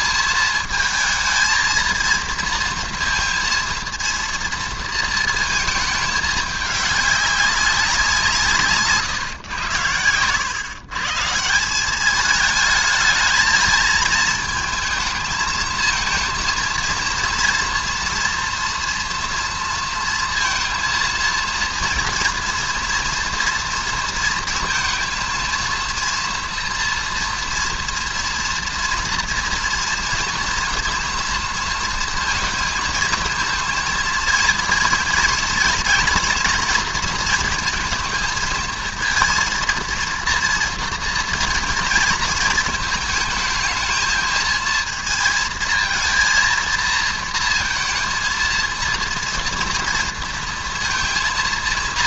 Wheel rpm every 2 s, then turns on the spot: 220, 230, 230, 210, 150, 120, 220, 220, 230, 230, 230, 240, 220, 230, 230, 240, 230, 230, 230, 230, 230, 230, 220, 230, 230, 230.
none